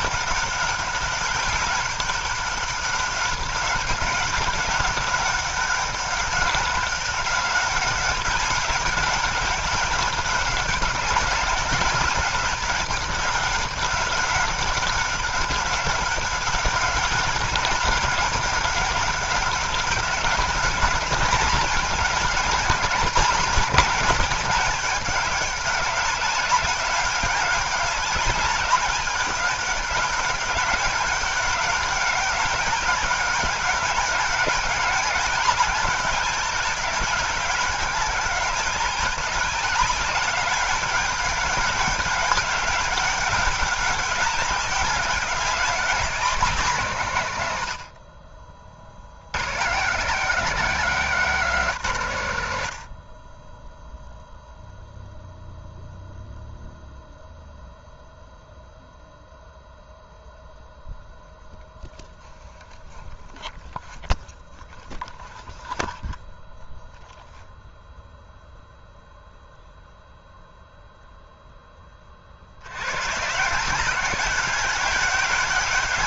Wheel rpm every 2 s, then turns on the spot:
200, 200, 200, 190, 190, 200, 200, 200, 190, 200, 210, 210, 210, 200, 200, 200, 190, 190, 200, 190, 200, 200, 190, 210, 60, 210, 90, 0, 0, 0, 0, 0, 0, 0, 0, 0, 90, 190.
none